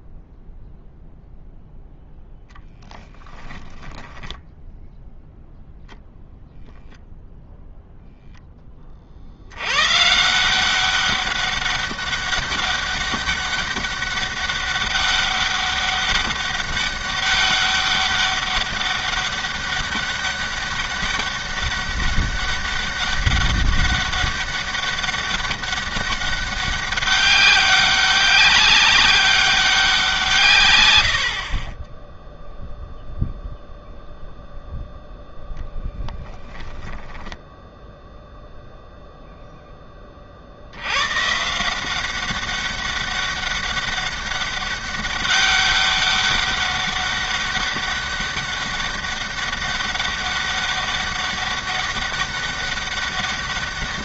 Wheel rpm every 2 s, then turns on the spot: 0, 10, 0, 0, 20, 190, 200, 200, 200, 200, 200, 200, 200, 190, 190, 120, 0, 0, 10, 0, 70, 190, 200, 200, 200, 200, 200.
36-38